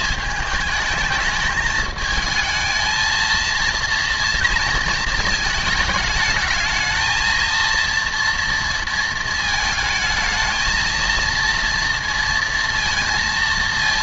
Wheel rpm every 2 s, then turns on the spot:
220, 220, 230, 220, 230, 220, 230.
none